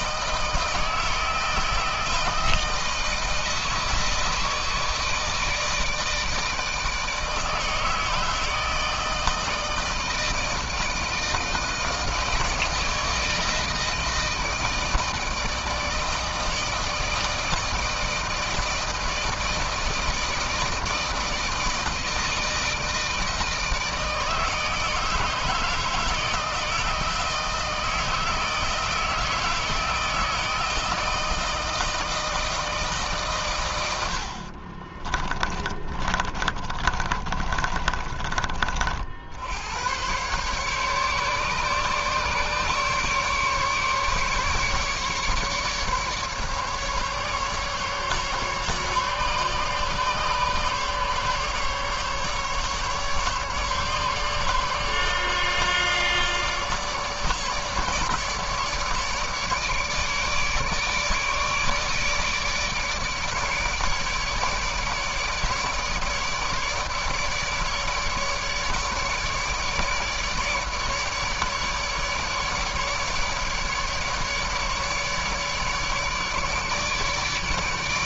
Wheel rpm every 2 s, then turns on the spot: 160, 160, 160, 160, 160, 160, 160, 160, 160, 160, 160, 160, 160, 160, 160, 160, 140, 30, 30, 60, 140, 140, 150, 150, 150, 140, 150, 150, 150, 150, 150, 150, 150, 150, 150, 150, 150, 150, 150.
34-38